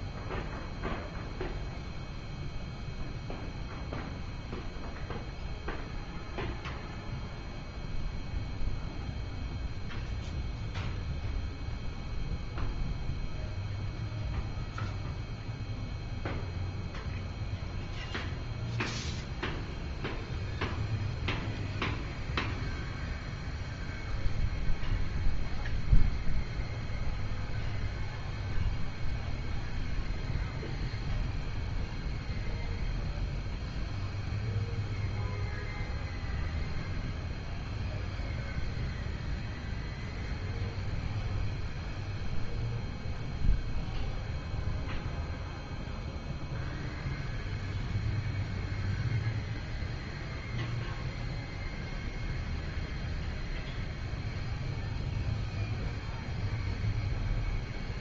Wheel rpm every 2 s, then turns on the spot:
0, 0, 0, 0, 0, 0, 0, 0, 0, 0, 0, 0, 0, 0, 0, 0, 0, 0, 0, 0, 0, 0, 0, 0, 0, 0, 0, 0, 0.
none